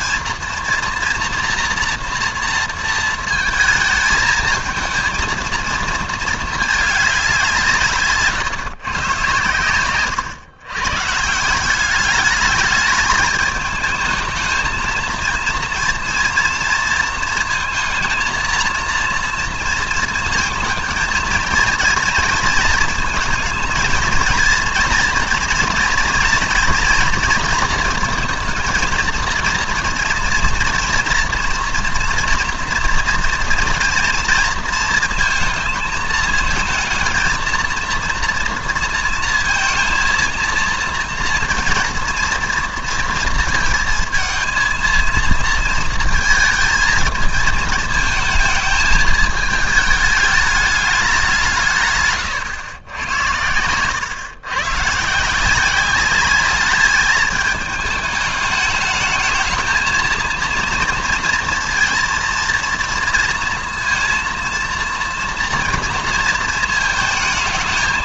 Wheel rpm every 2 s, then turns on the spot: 230, 230, 220, 220, 140, 130, 210, 220, 230, 230, 230, 230, 230, 230, 230, 230, 230, 230, 220, 230, 230, 230, 220, 220, 220, 210, 110, 130, 210, 220, 230, 230, 230, 220.
none